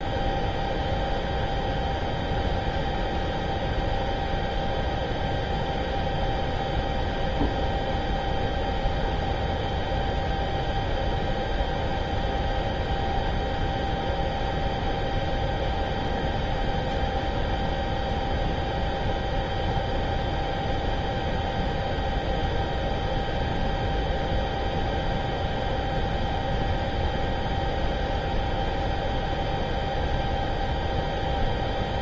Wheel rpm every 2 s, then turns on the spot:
0, 0, 0, 0, 0, 0, 0, 0, 0, 0, 0, 0, 0, 0, 0, 0.
none